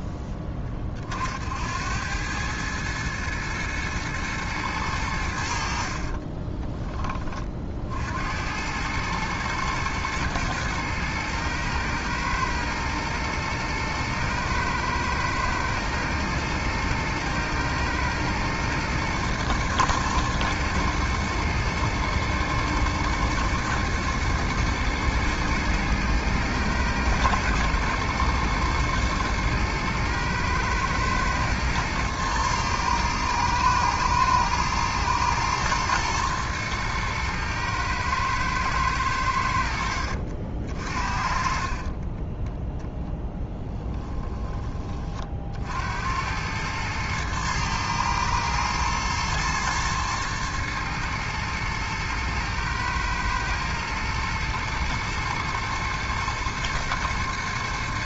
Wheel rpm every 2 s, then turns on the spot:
20, 110, 110, 20, 100, 110, 110, 110, 110, 120, 110, 110, 110, 120, 110, 110, 110, 110, 110, 110, 50, 10, 30, 110, 110, 110, 110, 110, 110.
none